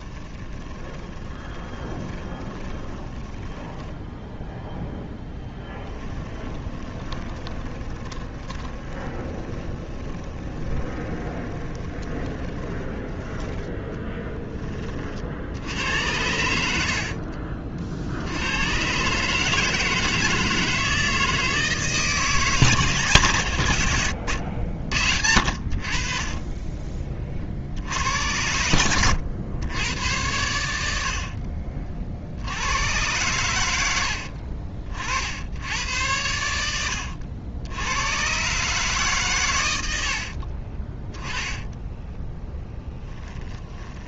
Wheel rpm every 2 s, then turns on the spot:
20, 20, 0, 20, 20, 20, 20, 40, 70, 120, 160, 160, 80, 30, 100, 80, 100, 60, 80, 140, 30, 10.
0-4 6-12 16-18 28-30 36-38 40-44